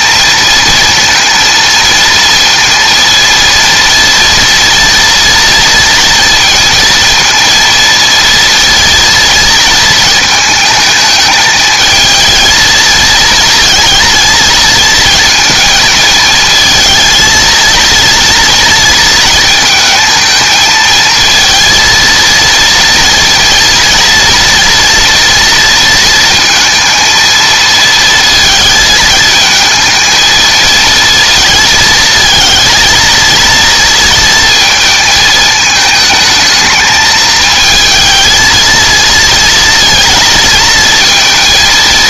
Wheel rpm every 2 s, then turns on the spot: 230, 230, 230, 230, 230, 220, 230, 230, 220, 230, 220, 230, 230, 230, 230, 230, 220, 220, 220, 230, 220.
none